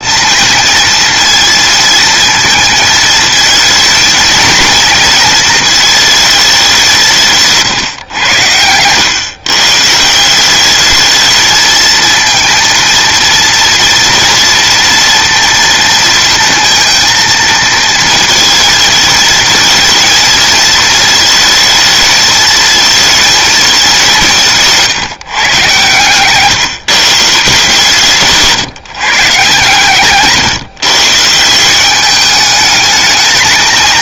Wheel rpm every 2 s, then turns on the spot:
230, 230, 220, 220, 110, 170, 230, 230, 230, 230, 230, 220, 180, 130, 140, 140, 200.
30-32